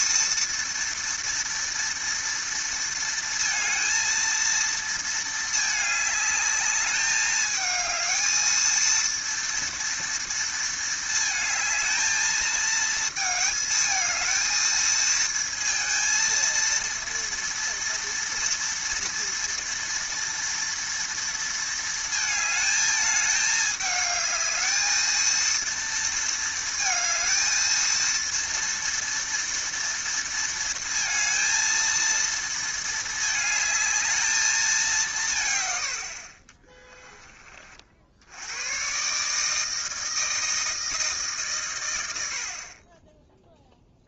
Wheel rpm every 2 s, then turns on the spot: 230, 230, 230, 210, 220, 230, 220, 220, 230, 230, 240, 220, 210, 230, 230, 230, 230, 220, 50, 60, 160, 90.
none